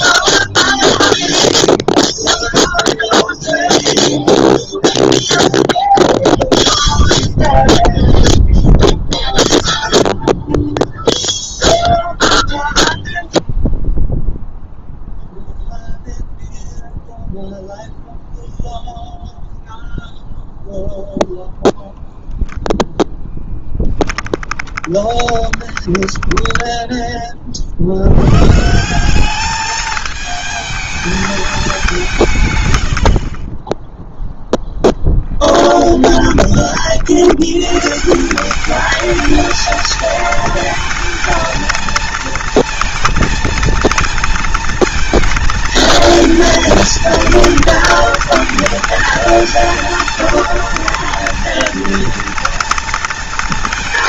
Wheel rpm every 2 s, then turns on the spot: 0, 0, 0, 0, 0, 0, 0, 0, 0, 0, 0, 10, 10, 10, 180, 220, 80, 0, 60, 210, 230, 230, 220, 230, 220, 230, 230.
24-26 32-34